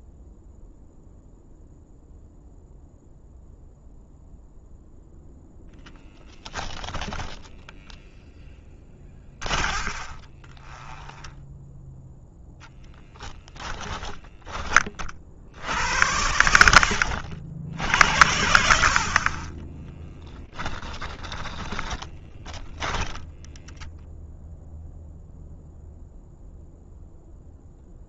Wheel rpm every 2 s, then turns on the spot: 0, 0, 0, 10, 20, 20, 10, 20, 90, 50, 20, 10, 0, 0.
8-12 16-18 20-24